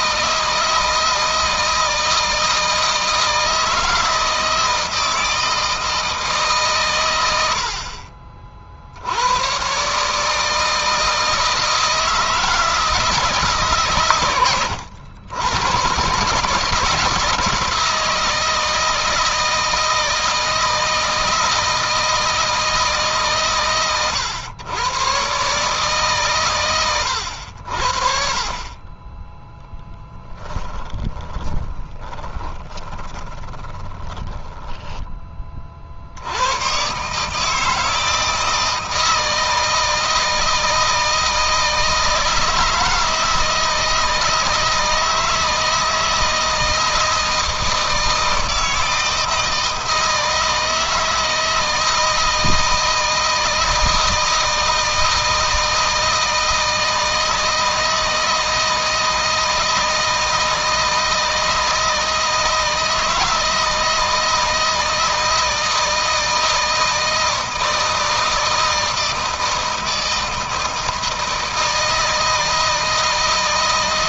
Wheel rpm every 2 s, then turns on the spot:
160, 160, 160, 130, 70, 160, 160, 90, 150, 160, 160, 150, 110, 110, 30, 20, 20, 20, 130, 160, 160, 160, 160, 160, 160, 160, 160, 160, 160, 160, 160, 160, 160, 160, 160, 160, 160.
30-34